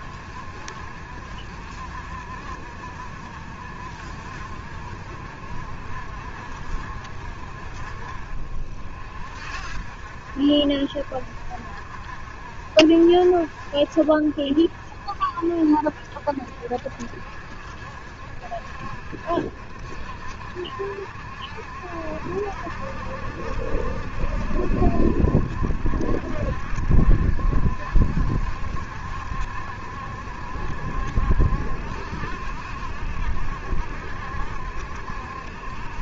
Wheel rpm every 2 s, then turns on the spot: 60, 50, 60, 60, 50, 50, 50, 40, 60, 60, 50, 50, 60, 70, 70, 70, 70, 70.
none